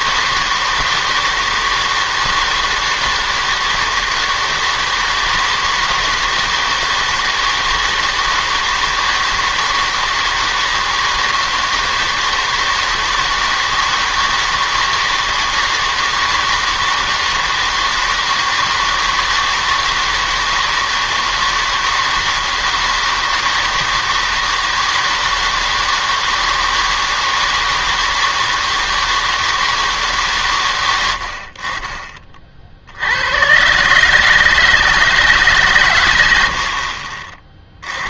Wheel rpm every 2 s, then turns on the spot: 160, 160, 160, 160, 160, 160, 160, 160, 160, 160, 160, 160, 160, 160, 160, 110, 60, 150, 70.
none